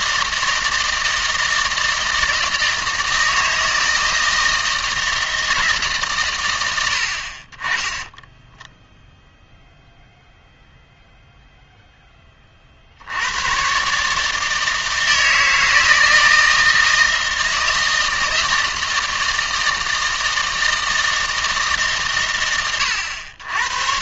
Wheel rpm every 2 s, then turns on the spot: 160, 160, 160, 90, 0, 0, 60, 160, 160, 160, 160, 100.
none